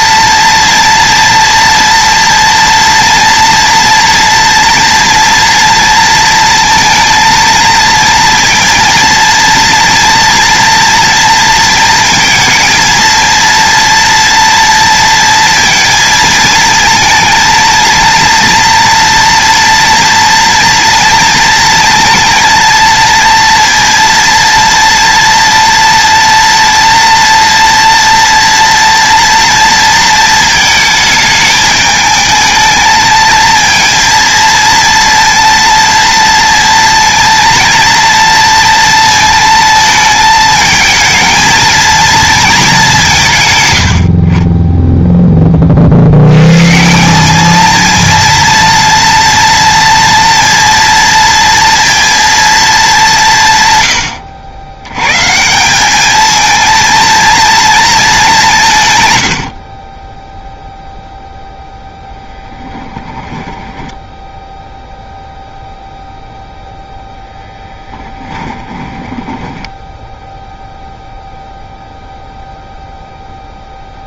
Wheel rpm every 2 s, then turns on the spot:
230, 230, 240, 230, 230, 230, 230, 230, 230, 230, 230, 230, 230, 230, 230, 220, 220, 230, 230, 230, 220, 180, 10, 180, 230, 230, 220, 100, 230, 120, 0, 10, 0, 0, 10, 0, 0.
58-60 62-64 68-70